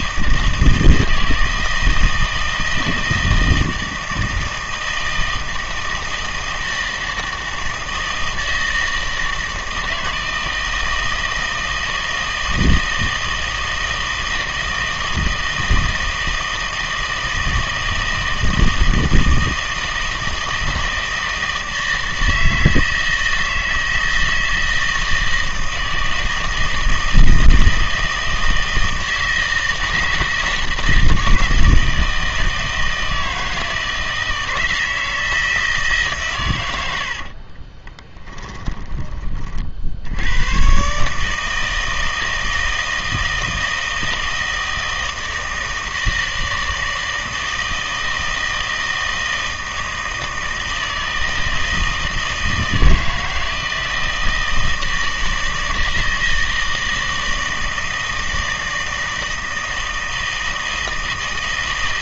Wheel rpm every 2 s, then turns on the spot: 160, 160, 160, 160, 160, 160, 160, 160, 160, 160, 160, 160, 160, 160, 160, 160, 160, 160, 100, 10, 120, 160, 160, 160, 160, 160, 160, 160, 160, 160, 160.
38-40